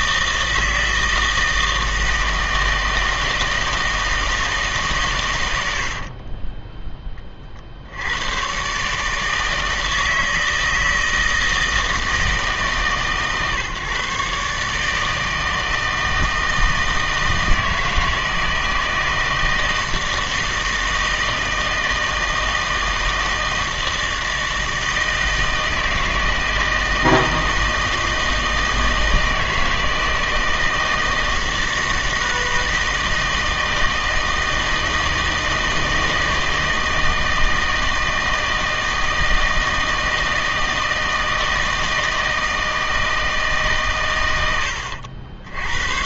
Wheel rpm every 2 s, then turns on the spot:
160, 160, 160, 20, 130, 160, 150, 150, 160, 160, 160, 160, 160, 160, 160, 160, 160, 160, 160, 160, 160, 160, 90.
6-8